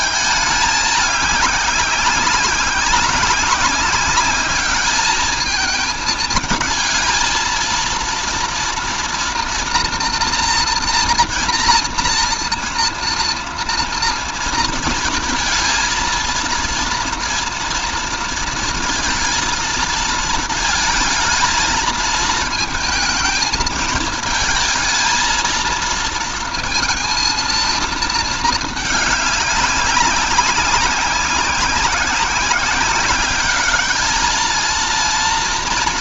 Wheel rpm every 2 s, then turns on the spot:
210, 190, 210, 220, 230, 230, 230, 230, 230, 220, 220, 220, 230, 230, 210, 190, 190, 230.
none